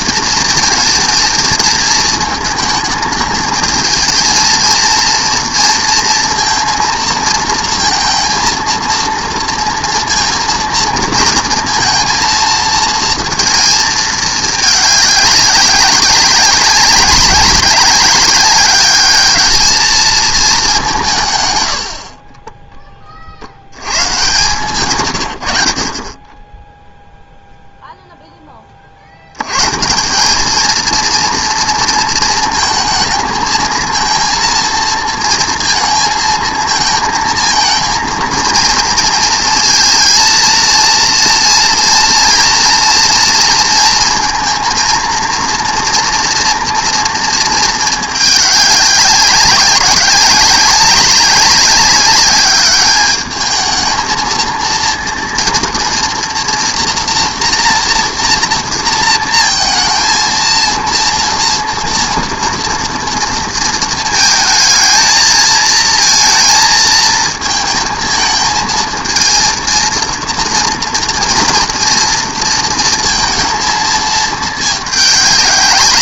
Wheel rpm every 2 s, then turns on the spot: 230, 220, 230, 230, 230, 230, 230, 210, 200, 200, 200, 20, 120, 10, 20, 220, 220, 230, 220, 230, 230, 230, 230, 240, 200, 190, 200, 230, 230, 230, 230, 240, 220, 230, 220, 230, 230, 220.
none